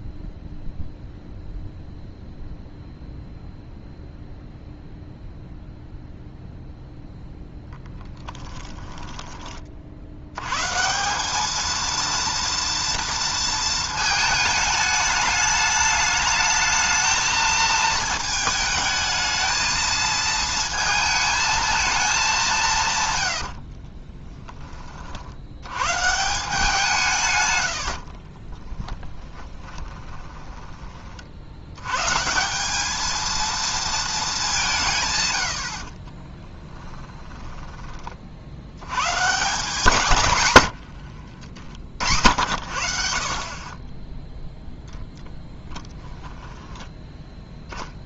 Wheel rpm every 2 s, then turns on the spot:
0, 0, 0, 0, 20, 140, 230, 210, 220, 220, 220, 160, 30, 170, 20, 20, 190, 170, 20, 80, 110, 70, 0, 10.
8-10 28-30 36-38 40-42 46-48